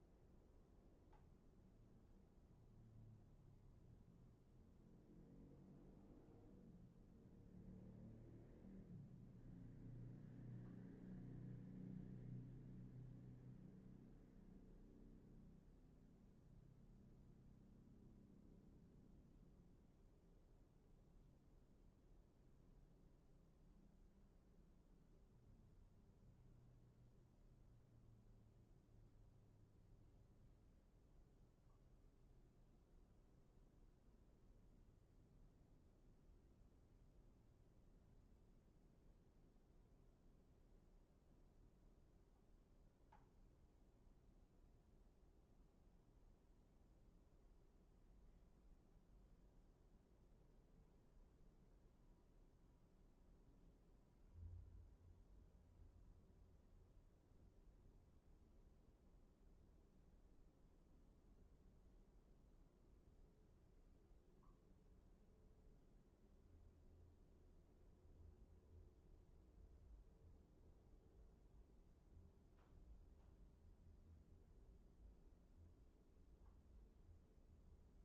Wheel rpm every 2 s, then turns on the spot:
0, 0, 0, 0, 0, 0, 0, 0, 0, 0, 0, 0, 0, 0, 0, 0, 0, 0, 0, 0, 0, 0, 0, 0, 0, 0, 0, 0, 0, 0, 0, 0, 0, 0, 0, 0, 0, 0, 0.
none